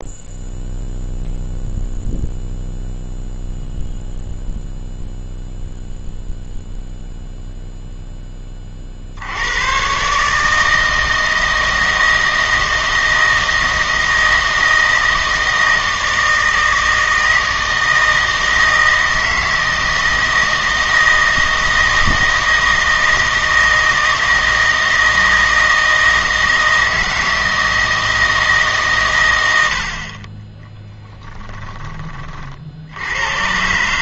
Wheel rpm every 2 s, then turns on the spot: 0, 0, 0, 0, 40, 160, 160, 160, 160, 160, 160, 160, 160, 160, 140, 10, 60.
30-32